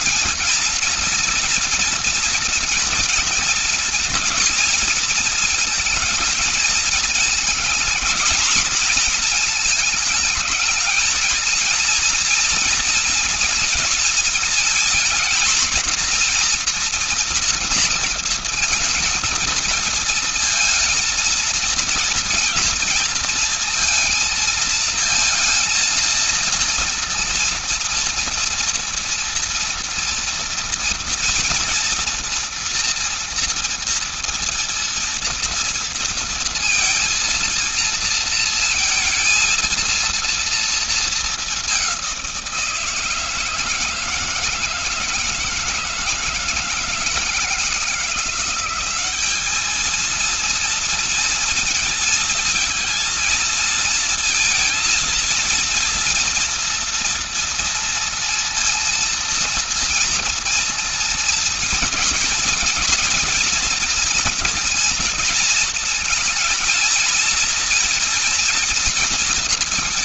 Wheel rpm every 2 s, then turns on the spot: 230, 230, 230, 220, 220, 220, 230, 240, 240, 220, 230, 230, 230, 230, 230, 230, 230, 230, 230, 230, 220, 170, 160, 160, 190, 230, 220, 230, 230, 230, 240, 230, 230, 230, 230.
none